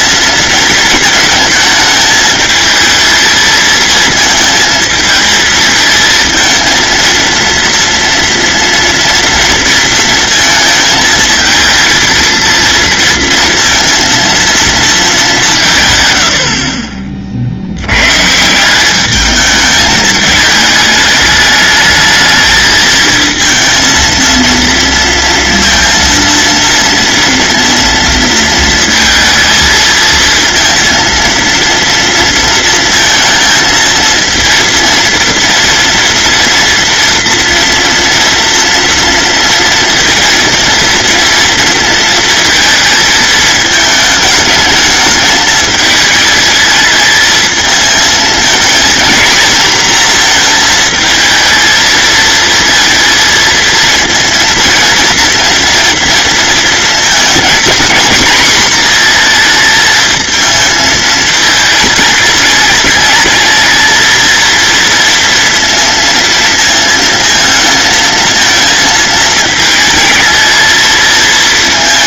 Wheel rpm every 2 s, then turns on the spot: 220, 220, 220, 230, 230, 220, 230, 230, 50, 190, 210, 220, 230, 230, 220, 230, 230, 230, 230, 230, 230, 230, 210, 220, 230, 230, 230, 230, 230, 240, 220, 220, 230, 230, 220, 220.
none